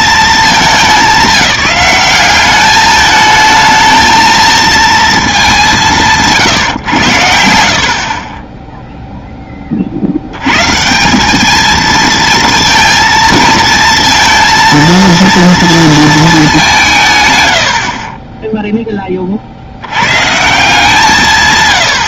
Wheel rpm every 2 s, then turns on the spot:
190, 220, 200, 70, 20, 210, 230, 230, 100, 30, 150.
none